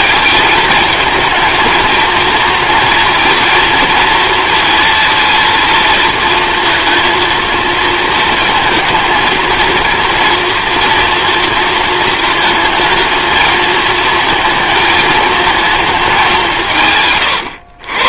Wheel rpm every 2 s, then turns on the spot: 220, 230, 230, 230, 220, 230, 220, 220, 150.
none